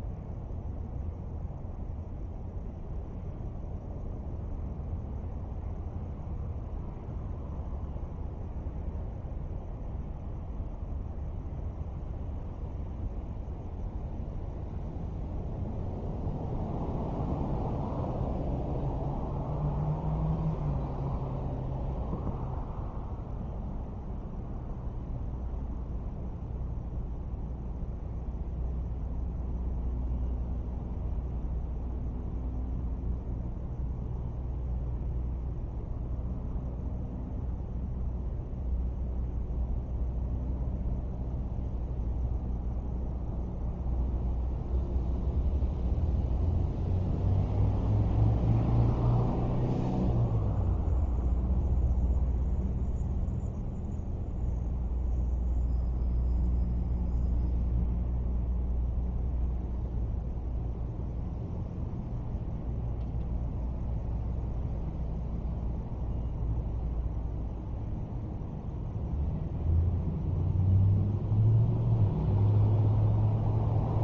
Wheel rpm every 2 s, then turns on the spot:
0, 0, 0, 0, 0, 0, 0, 0, 0, 0, 0, 0, 0, 0, 0, 0, 0, 0, 0, 0, 0, 0, 0, 0, 0, 0, 0, 0, 0, 0, 0, 0, 0, 0, 0, 0, 0.
none